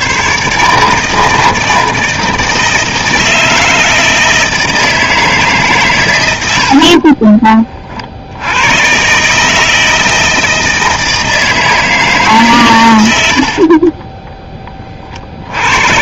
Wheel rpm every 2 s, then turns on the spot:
140, 160, 160, 70, 100, 160, 130, 20.
6-8